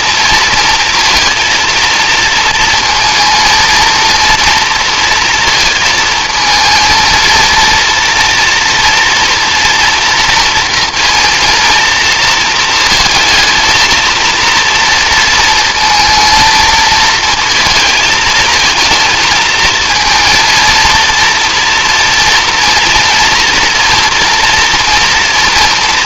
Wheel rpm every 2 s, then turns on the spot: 230, 230, 230, 230, 230, 230, 230, 230, 230, 220, 230, 230, 230.
none